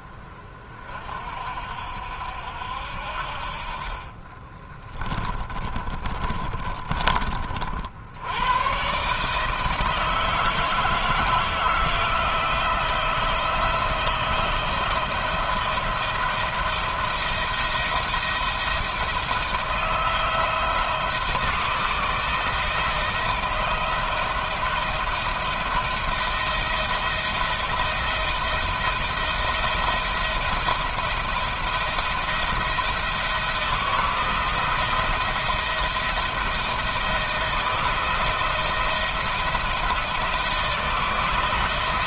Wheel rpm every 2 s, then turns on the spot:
30, 60, 20, 30, 120, 160, 170, 170, 170, 160, 160, 160, 160, 170, 170, 170, 170, 160, 160, 170, 170.
4-6